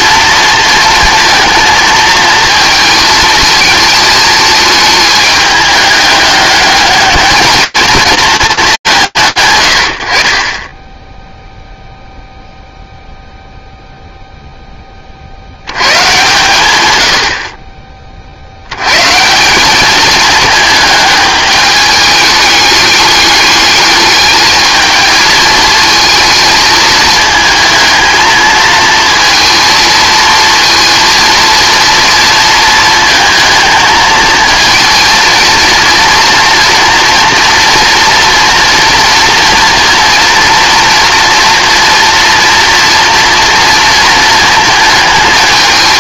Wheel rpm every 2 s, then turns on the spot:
230, 220, 220, 210, 190, 20, 0, 20, 100, 120, 210, 210, 220, 220, 220, 230, 220, 230, 230, 240, 230, 230, 220.
none